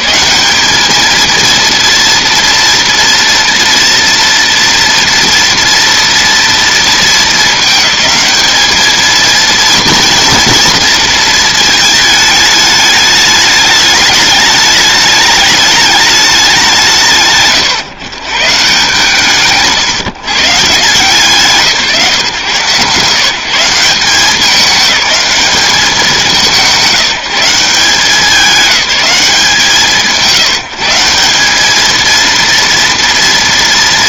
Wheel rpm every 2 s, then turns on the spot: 210, 230, 230, 230, 210, 230, 210, 210, 190, 140, 130, 130, 200, 170, 200, 170, 230.
none